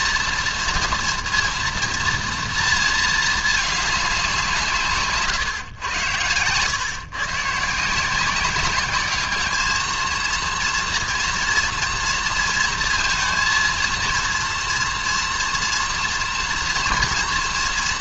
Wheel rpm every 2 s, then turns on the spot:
230, 230, 180, 120, 190, 230, 230, 230, 240.
none